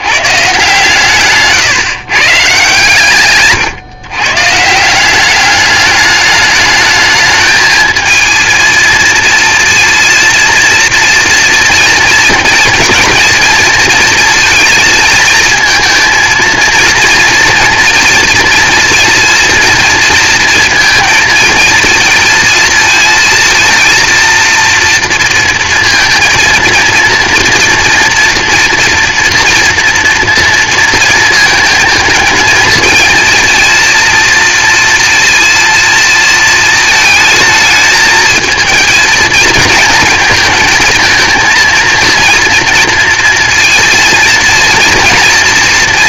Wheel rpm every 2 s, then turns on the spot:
140, 150, 150, 210, 220, 230, 230, 220, 230, 230, 230, 220, 230, 230, 230, 230, 220, 230, 220, 230, 230, 230, 230.
none